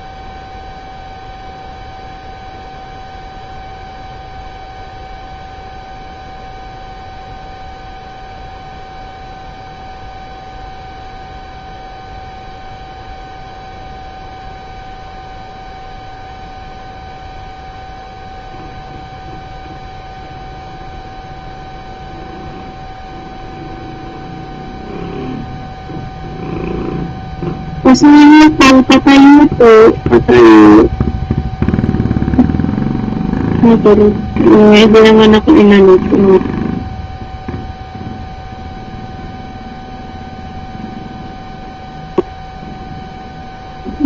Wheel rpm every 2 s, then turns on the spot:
0, 0, 0, 0, 0, 0, 0, 0, 0, 0, 0, 0, 0, 0, 0, 0, 0, 0, 0, 0, 0, 0.
none